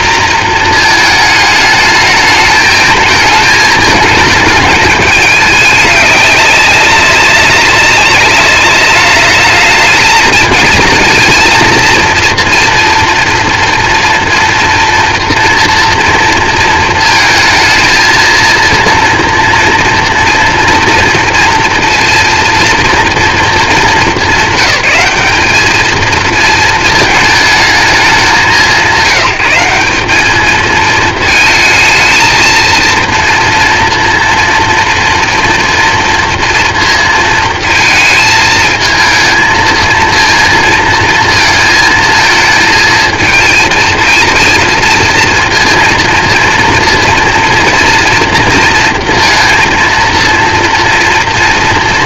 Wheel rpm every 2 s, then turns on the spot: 250, 220, 210, 200, 200, 220, 230, 240, 230, 230, 230, 230, 210, 220, 200, 200, 220, 230, 230, 220, 230, 220, 220, 230, 230, 230.
none